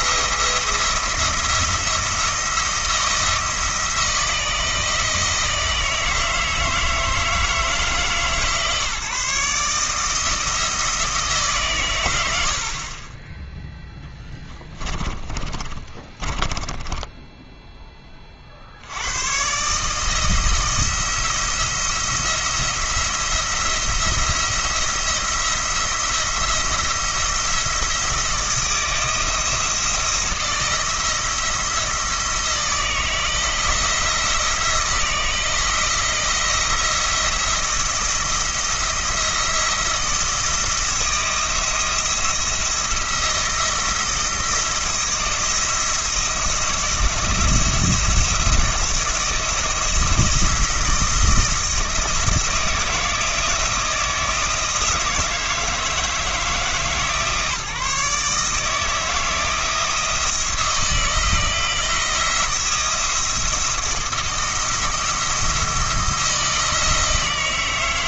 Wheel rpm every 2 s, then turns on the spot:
170, 160, 160, 160, 150, 130, 0, 20, 10, 90, 170, 170, 170, 170, 160, 160, 160, 170, 170, 170, 170, 170, 170, 170, 170, 170, 160, 160, 160, 160, 160, 170, 170, 160.
14-18